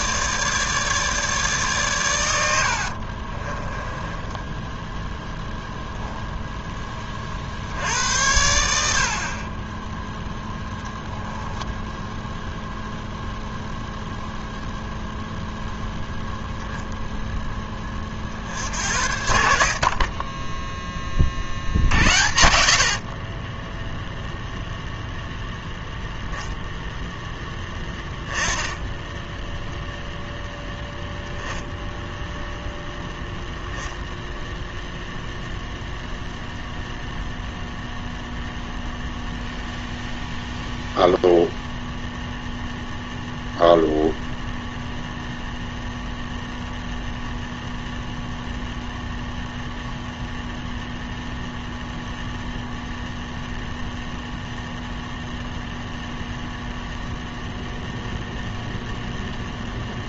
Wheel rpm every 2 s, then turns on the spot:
150, 50, 10, 20, 60, 0, 0, 0, 0, 70, 20, 60, 0, 0, 10, 0, 0, 0, 0, 0, 0, 0, 0, 0, 0, 0, 0, 0, 0, 0.
2-4